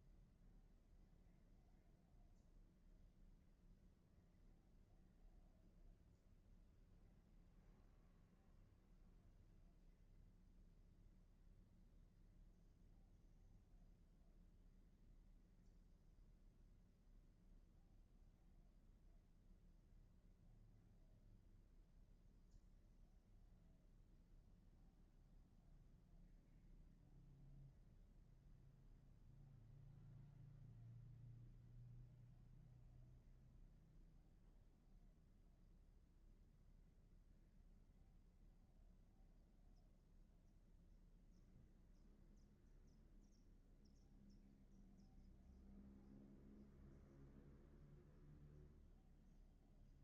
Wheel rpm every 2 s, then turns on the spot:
0, 0, 0, 0, 0, 0, 0, 0, 0, 0, 0, 0, 0, 0, 0, 0, 0, 0, 0, 0, 0, 0, 0, 0, 0.
none